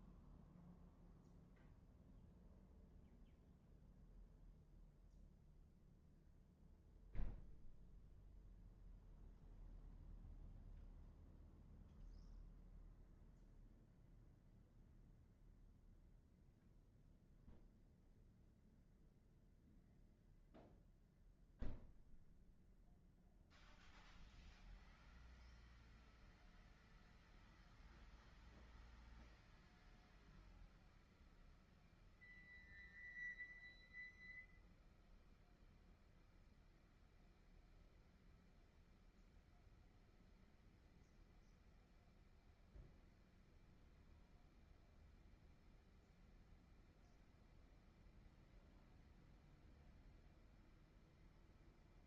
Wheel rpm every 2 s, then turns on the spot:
0, 0, 0, 0, 0, 0, 0, 0, 0, 0, 0, 0, 0, 0, 0, 0, 0, 0, 0, 0, 0, 0, 0, 0, 0, 0.
none